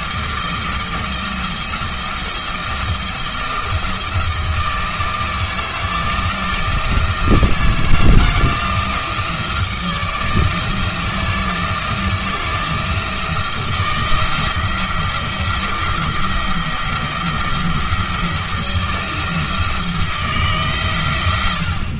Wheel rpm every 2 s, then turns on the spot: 160, 170, 160, 160, 170, 170, 170, 160, 170, 170, 140.
none